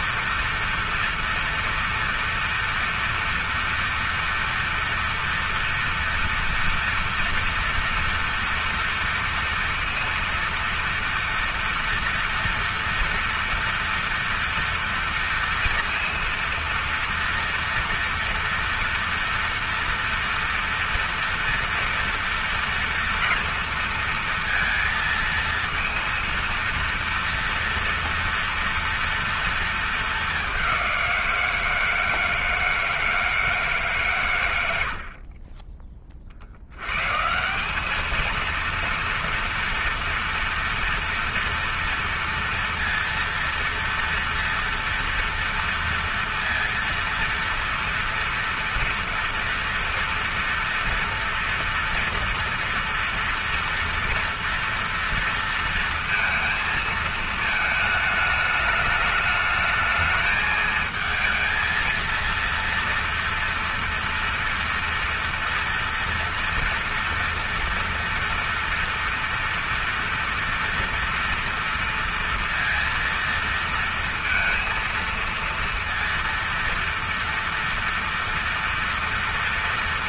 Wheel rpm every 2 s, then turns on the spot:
240, 230, 230, 230, 230, 230, 230, 230, 230, 230, 230, 230, 230, 230, 230, 190, 160, 100, 90, 230, 230, 230, 230, 230, 230, 230, 230, 230, 230, 210, 220, 230, 230, 230, 230, 230, 230, 230, 230, 230.
none